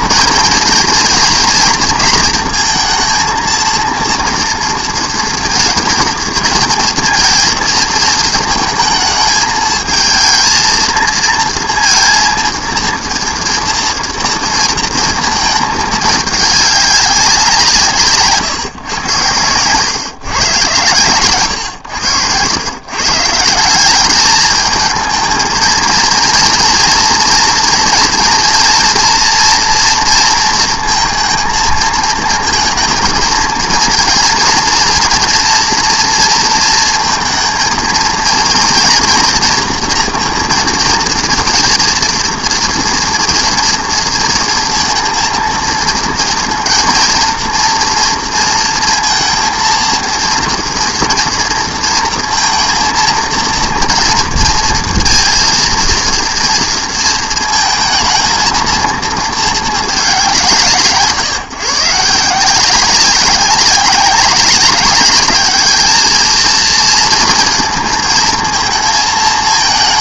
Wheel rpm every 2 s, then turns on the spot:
230, 230, 230, 230, 220, 230, 230, 230, 200, 120, 120, 120, 220, 230, 230, 230, 230, 240, 230, 230, 240, 230, 230, 230, 230, 230, 230, 230, 230, 230, 160, 190, 200, 230, 220.
none